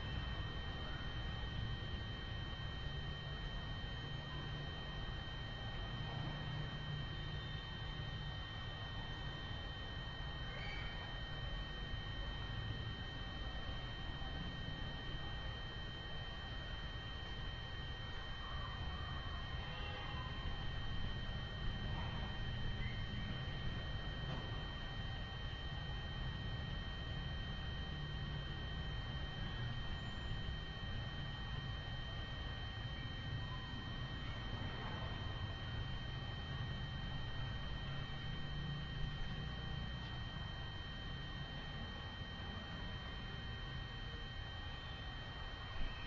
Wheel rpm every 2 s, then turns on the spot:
0, 0, 0, 0, 0, 0, 0, 0, 0, 0, 0, 0, 0, 0, 0, 0, 0, 0, 0, 0, 0, 0, 0.
none